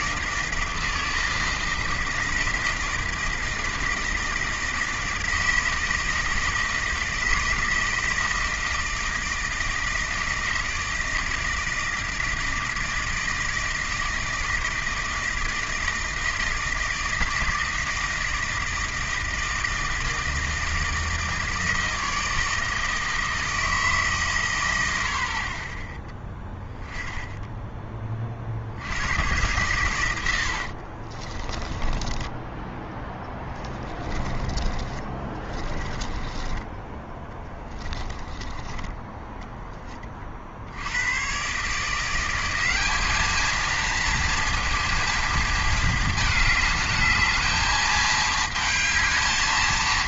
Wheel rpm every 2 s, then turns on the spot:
160, 160, 160, 160, 160, 160, 160, 160, 160, 160, 160, 160, 100, 10, 70, 60, 10, 30, 20, 20, 80, 190, 230, 210, 220.
30-32 34-36 38-40